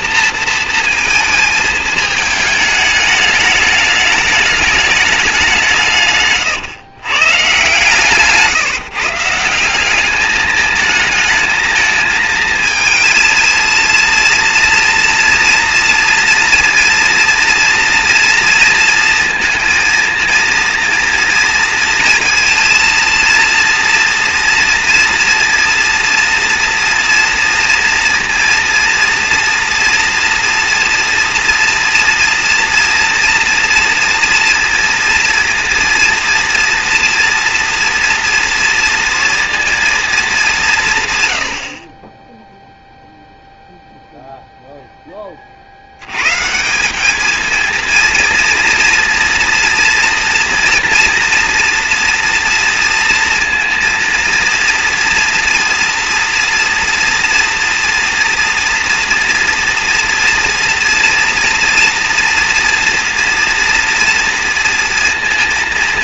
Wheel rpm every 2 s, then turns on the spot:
220, 210, 180, 130, 170, 220, 220, 230, 240, 230, 230, 230, 230, 230, 230, 230, 230, 230, 240, 230, 90, 0, 10, 200, 230, 230, 230, 230, 230, 230, 230, 230, 230.
none